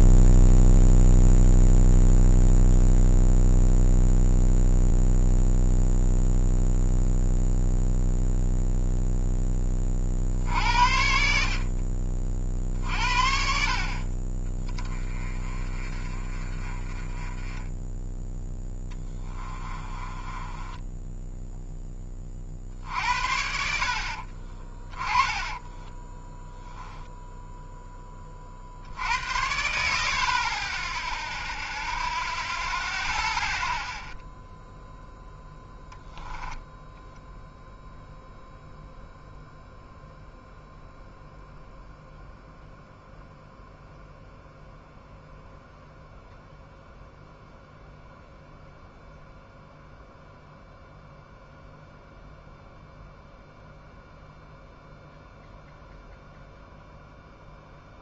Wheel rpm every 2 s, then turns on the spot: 0, 0, 0, 0, 0, 60, 50, 20, 30, 20, 10, 50, 30, 0, 50, 20, 0, 0, 10, 0, 0, 0, 0, 0, 0, 0, 0, 0, 0.
18-22 24-26 36-38